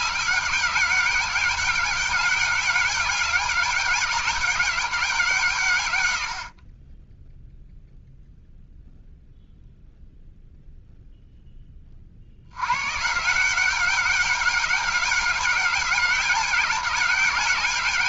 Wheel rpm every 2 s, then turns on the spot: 190, 200, 190, 30, 0, 0, 110, 200, 200.
none